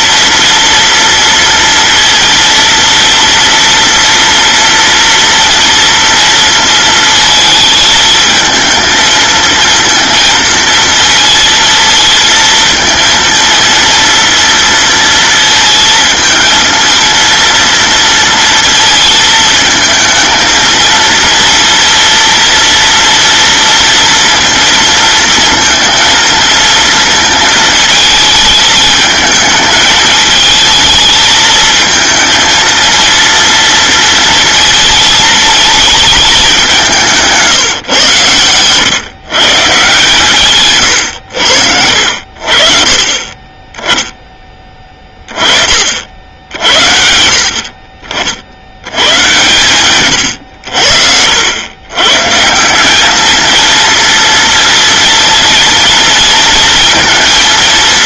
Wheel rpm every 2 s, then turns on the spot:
230, 230, 230, 230, 220, 230, 230, 230, 230, 230, 230, 230, 230, 230, 220, 220, 230, 230, 200, 120, 140, 50, 20, 70, 80, 80, 180, 230, 230.
40-42